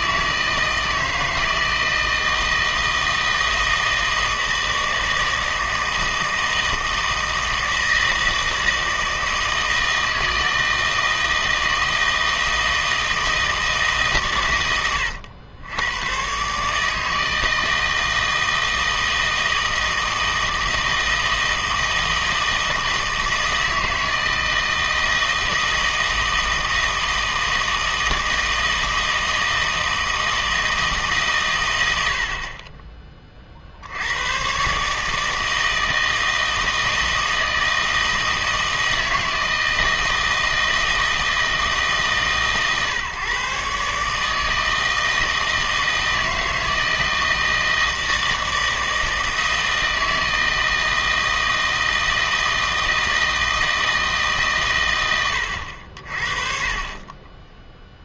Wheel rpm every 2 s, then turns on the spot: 160, 160, 160, 160, 160, 160, 160, 100, 150, 160, 160, 160, 160, 160, 160, 160, 40, 140, 160, 160, 160, 130, 160, 160, 160, 160, 160, 130, 30.
none